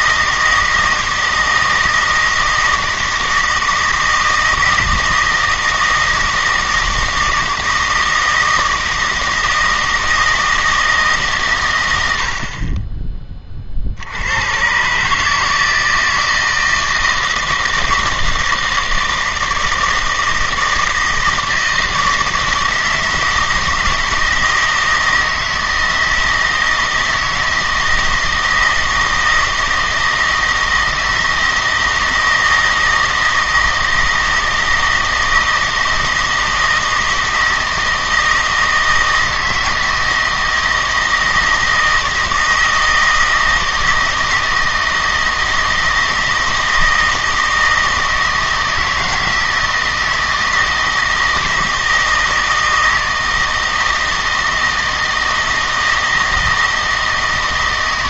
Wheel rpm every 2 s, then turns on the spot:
160, 160, 160, 160, 160, 160, 30, 120, 160, 160, 160, 160, 160, 160, 160, 160, 160, 160, 160, 160, 160, 160, 160, 160, 160, 160, 160, 160, 160.
none